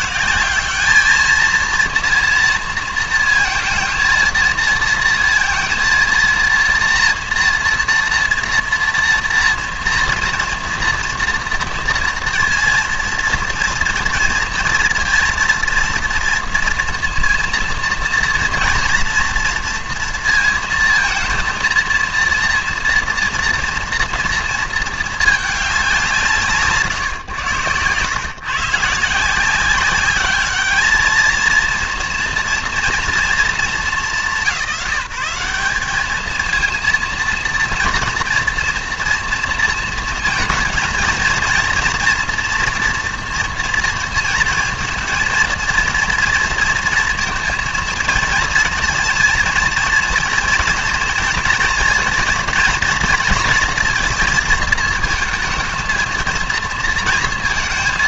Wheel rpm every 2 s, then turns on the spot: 200, 230, 230, 230, 230, 230, 230, 230, 230, 230, 230, 230, 230, 150, 140, 210, 230, 180, 220, 230, 230, 230, 230, 230, 230, 230, 230, 220, 230.
none